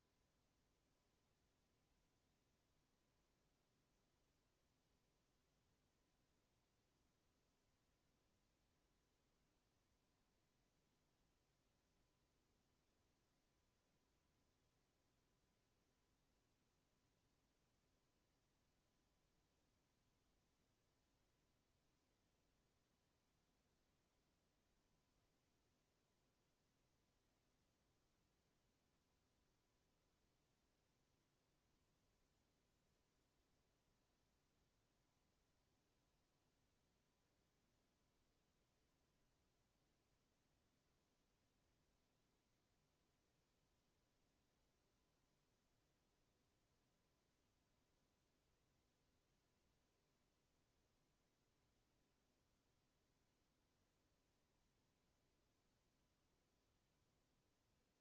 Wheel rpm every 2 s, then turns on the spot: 0, 0, 0, 0, 0, 0, 0, 0, 0, 0, 0, 0, 0, 0, 0, 0, 0, 0, 0, 0, 0, 0, 0, 0, 0, 0, 0, 0, 0.
none